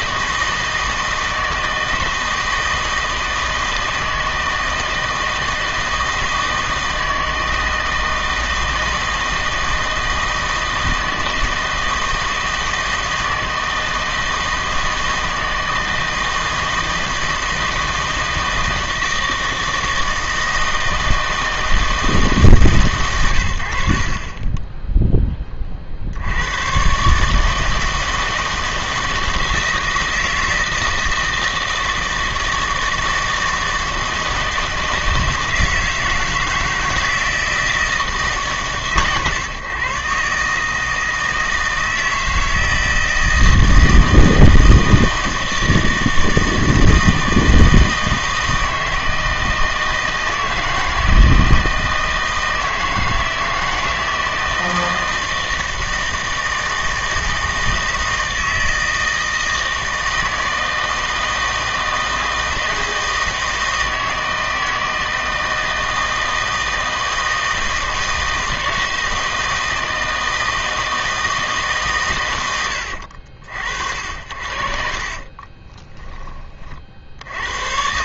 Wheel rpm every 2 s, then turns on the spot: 160, 160, 160, 160, 160, 160, 160, 160, 160, 160, 160, 140, 10, 120, 160, 160, 160, 160, 160, 150, 150, 160, 160, 160, 160, 170, 160, 160, 160, 160, 160, 160, 160, 160, 160, 160, 80, 60, 40.
74-76